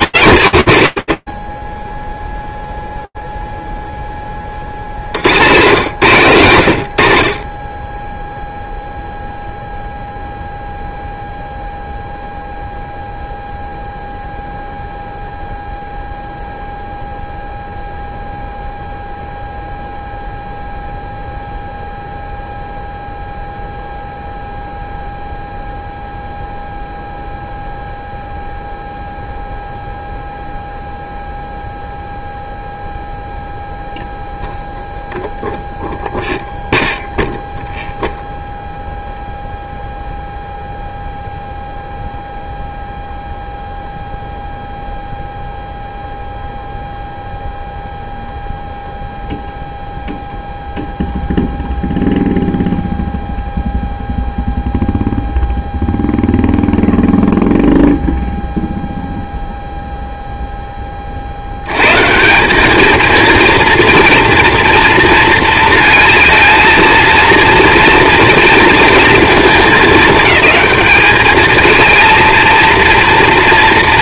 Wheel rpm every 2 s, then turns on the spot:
160, 0, 30, 90, 0, 0, 0, 0, 0, 0, 0, 0, 0, 0, 0, 0, 0, 0, 0, 0, 0, 0, 0, 0, 0, 0, 0, 0, 0, 0, 30, 220, 230, 230, 220, 210, 230.
none